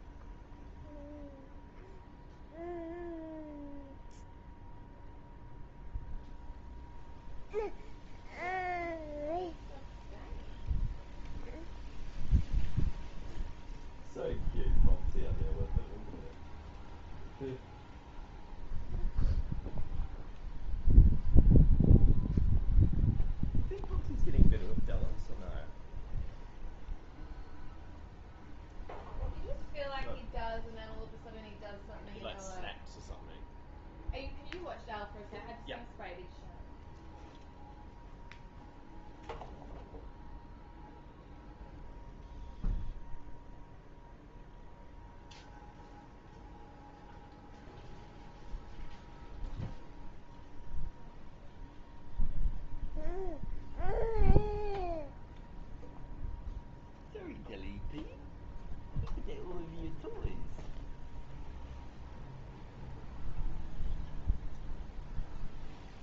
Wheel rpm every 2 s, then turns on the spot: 0, 0, 0, 0, 0, 0, 0, 0, 0, 0, 0, 0, 0, 0, 0, 0, 0, 0, 0, 0, 0, 0, 0, 0, 0, 0, 0, 0, 0, 0, 0, 0, 0.
none